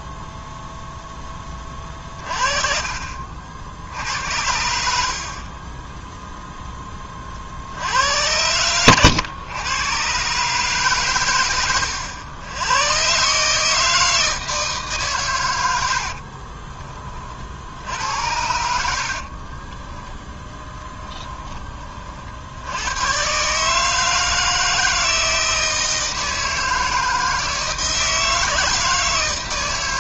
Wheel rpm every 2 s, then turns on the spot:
0, 40, 70, 20, 100, 130, 120, 140, 30, 60, 20, 100, 160, 160, 160.
18-22